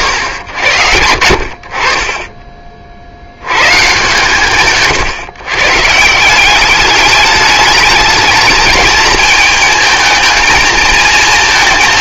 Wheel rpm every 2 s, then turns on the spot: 80, 30, 140, 200, 220, 230.
none